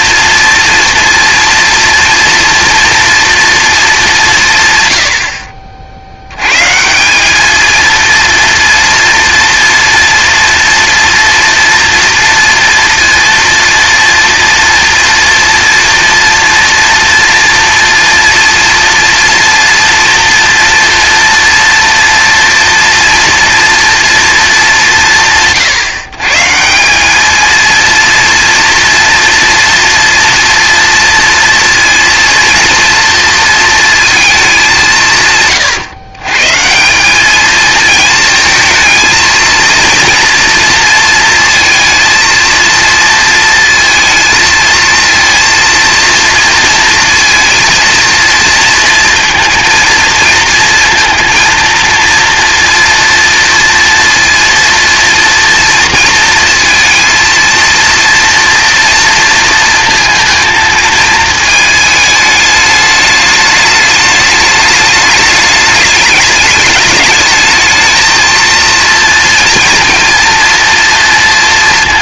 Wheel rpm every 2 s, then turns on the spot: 230, 230, 120, 150, 230, 230, 230, 230, 230, 230, 230, 230, 190, 190, 230, 240, 230, 180, 170, 220, 230, 230, 230, 230, 230, 230, 230, 230, 230, 230, 230, 210, 210, 210, 230, 230.
none